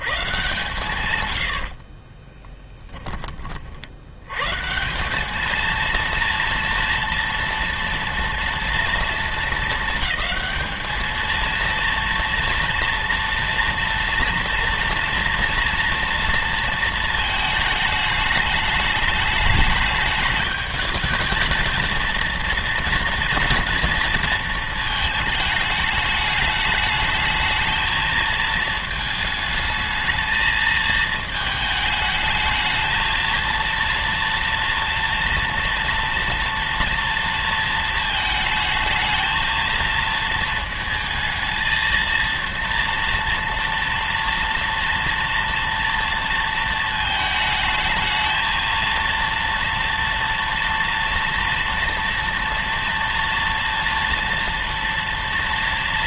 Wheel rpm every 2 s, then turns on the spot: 140, 20, 160, 230, 230, 220, 230, 230, 220, 210, 220, 230, 230, 210, 220, 220, 220, 230, 230, 220, 230, 230, 230, 230, 230, 230, 230, 230.
2-4